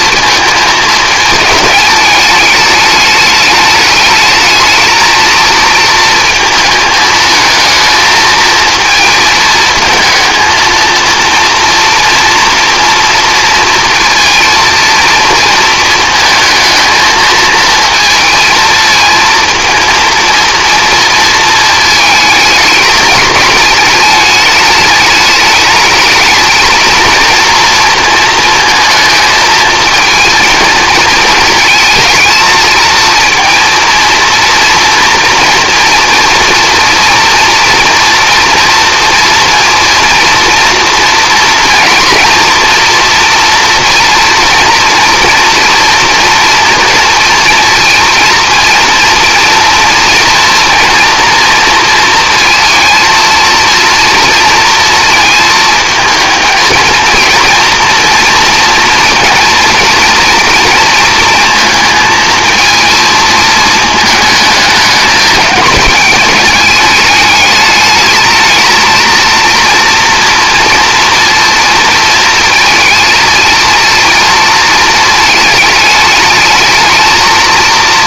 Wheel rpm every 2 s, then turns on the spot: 220, 210, 220, 220, 220, 230, 230, 230, 220, 220, 230, 220, 210, 230, 230, 220, 220, 230, 230, 230, 230, 240, 230, 240, 230, 230, 230, 230, 230, 240, 230, 220, 210, 210, 230, 230, 220, 220, 220.
none